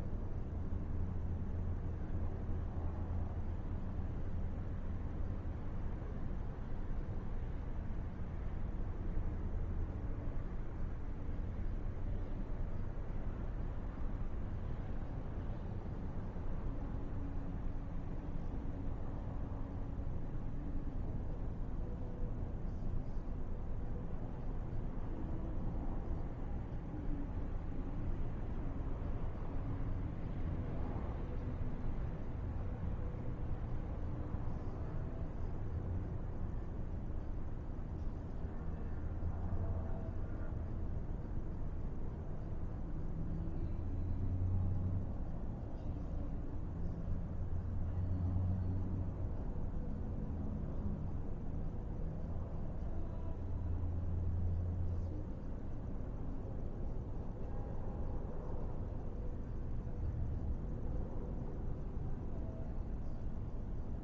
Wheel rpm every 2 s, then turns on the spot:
0, 0, 0, 0, 0, 0, 0, 0, 0, 0, 0, 0, 0, 0, 0, 0, 0, 0, 0, 0, 0, 0, 0, 0, 0, 0, 0, 0, 0, 0, 0, 0.
none